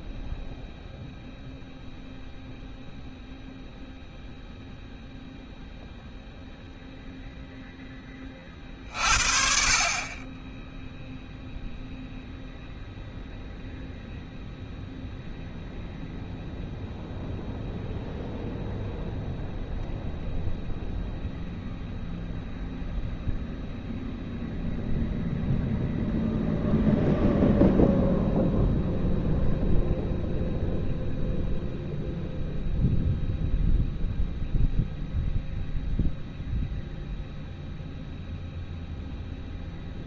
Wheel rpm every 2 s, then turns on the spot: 0, 0, 0, 0, 20, 30, 0, 0, 0, 0, 0, 0, 0, 0, 0, 0, 0, 0, 0, 0.
none